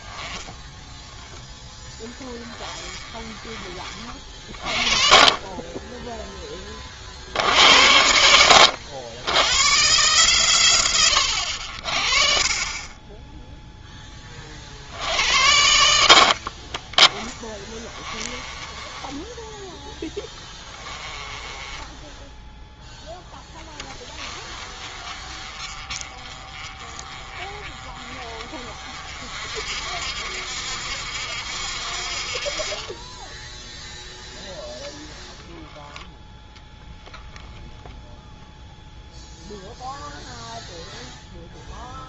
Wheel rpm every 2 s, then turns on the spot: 10, 20, 40, 30, 80, 100, 30, 60, 30, 20, 20, 10, 60, 60, 60, 60, 20, 10, 10, 0, 0.
0-4 16-22 34-38